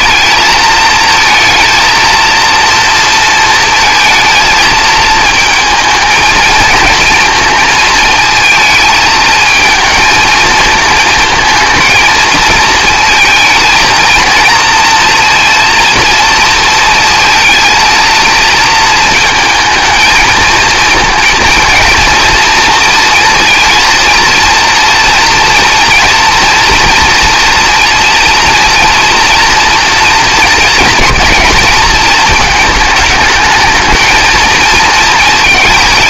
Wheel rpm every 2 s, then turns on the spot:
220, 230, 220, 220, 220, 220, 230, 230, 230, 230, 230, 230, 230, 230, 230, 220, 220, 220.
none